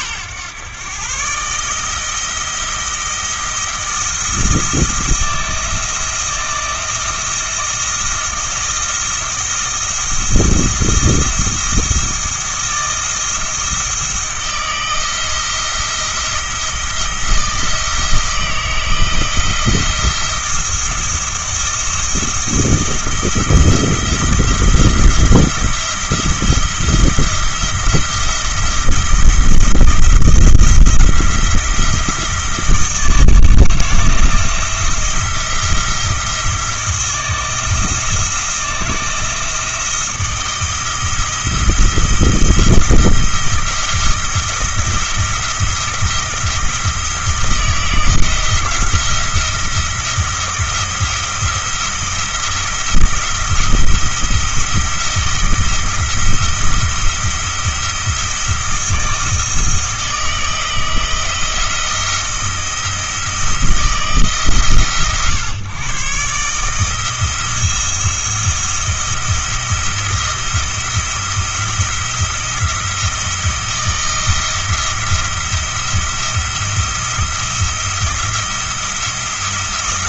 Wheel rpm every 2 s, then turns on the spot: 120, 170, 170, 170, 160, 160, 170, 170, 170, 160, 170, 170, 170, 160, 170, 170, 160, 160, 170, 170, 170, 170, 170, 170, 170, 170, 170, 170, 170, 160, 160, 160, 140, 160, 170, 170, 170, 170, 170, 170.
none